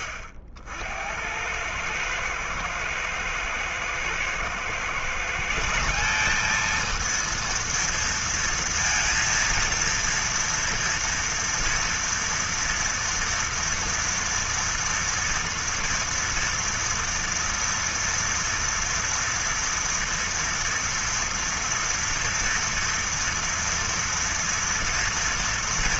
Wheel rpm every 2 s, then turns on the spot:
90, 120, 120, 210, 230, 230, 230, 230, 230, 230, 240, 230, 230.
none